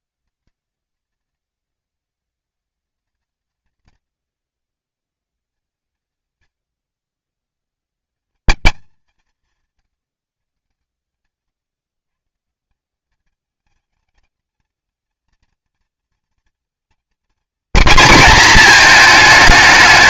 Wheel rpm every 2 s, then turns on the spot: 210, 210, 160, 140, 210, 140, 170, 220, 220, 220.
none